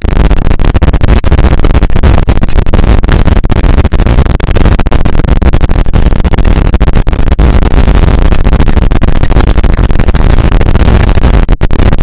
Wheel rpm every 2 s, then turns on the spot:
230, 230, 230, 230, 230, 220.
none